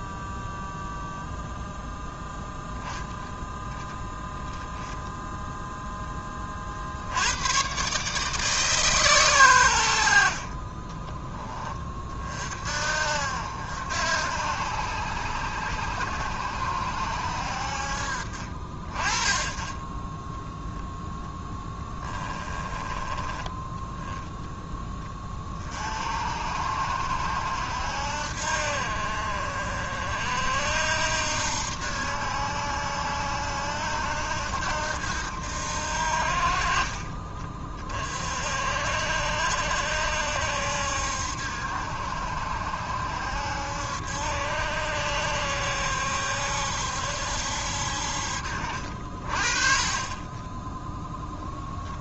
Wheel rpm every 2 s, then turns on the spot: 0, 10, 0, 60, 140, 20, 60, 80, 70, 30, 0, 20, 20, 70, 50, 70, 80, 80, 40, 70, 70, 70, 70, 70, 60, 10.
none